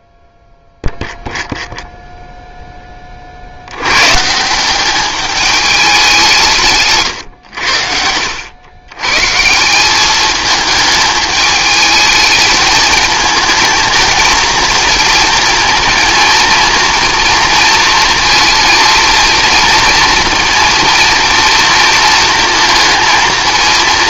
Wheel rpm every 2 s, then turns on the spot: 0, 0, 180, 150, 100, 210, 220, 220, 230, 230, 230, 230.
none